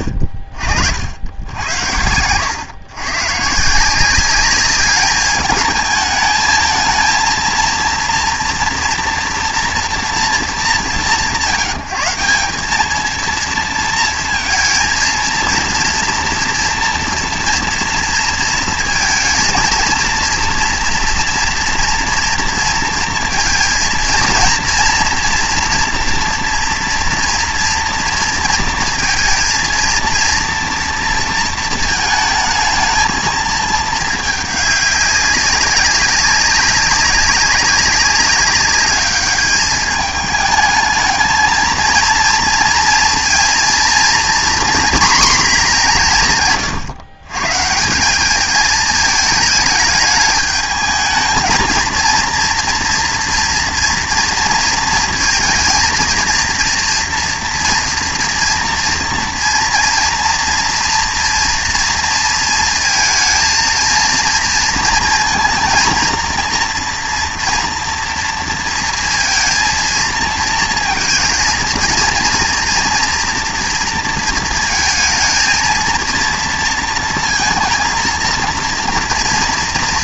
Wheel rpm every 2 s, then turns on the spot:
50, 120, 200, 220, 230, 170, 200, 220, 230, 230, 230, 230, 240, 240, 230, 230, 220, 210, 200, 200, 220, 230, 240, 130, 220, 210, 230, 230, 230, 230, 240, 230, 230, 230, 230, 220, 230, 230, 230, 230.
none